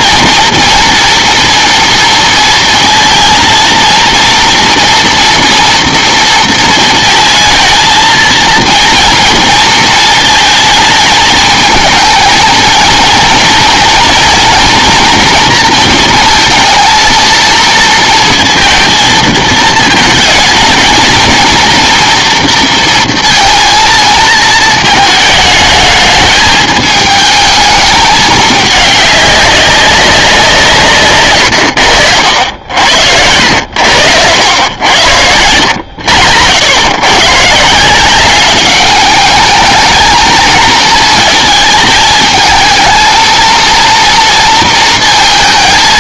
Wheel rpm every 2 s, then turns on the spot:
230, 230, 240, 230, 230, 220, 230, 240, 230, 230, 220, 230, 230, 220, 210, 160, 70, 90, 90, 200, 230, 220, 230.
none